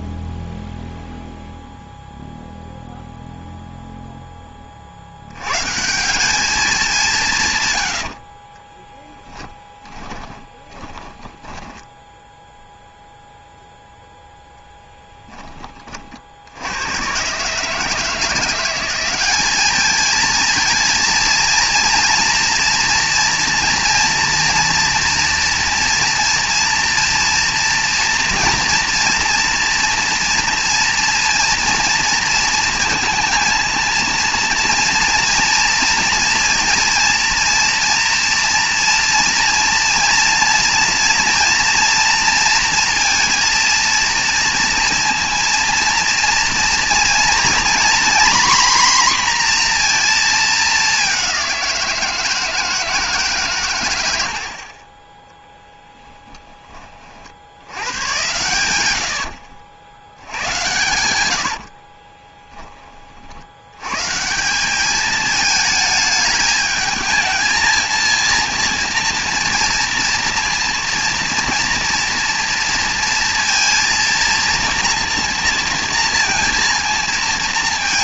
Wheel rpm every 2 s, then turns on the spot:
0, 0, 20, 200, 40, 20, 0, 0, 80, 170, 230, 230, 240, 230, 230, 230, 230, 230, 230, 230, 230, 230, 230, 230, 250, 220, 160, 80, 10, 100, 90, 10, 170, 220, 230, 230, 230, 230, 230.
8-12